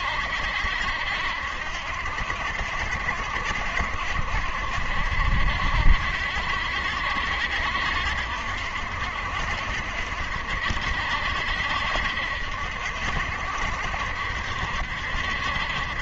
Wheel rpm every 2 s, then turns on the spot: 70, 60, 60, 70, 70, 70, 70, 70.
none